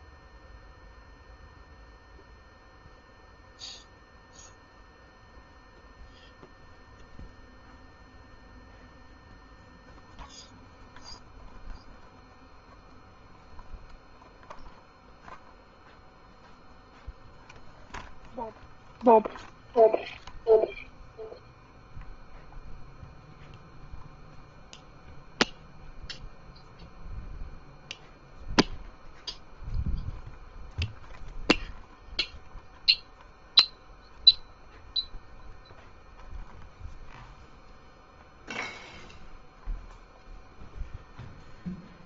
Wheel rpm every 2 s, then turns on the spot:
0, 0, 0, 0, 0, 0, 0, 0, 0, 0, 0, 0, 0, 0, 0, 0, 0, 0, 0, 0, 0.
none